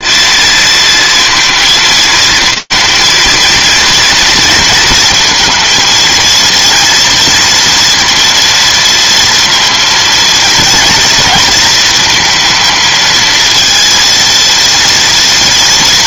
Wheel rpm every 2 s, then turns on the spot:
230, 230, 230, 230, 230, 230, 230, 240.
none